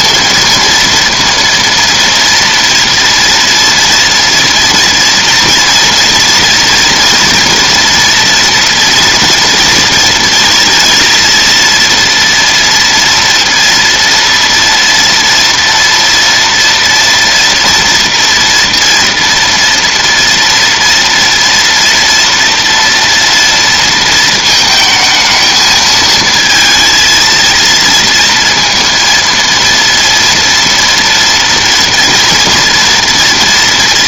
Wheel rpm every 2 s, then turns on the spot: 230, 230, 230, 230, 240, 230, 230, 230, 230, 230, 230, 230, 220, 230, 230, 230, 230.
none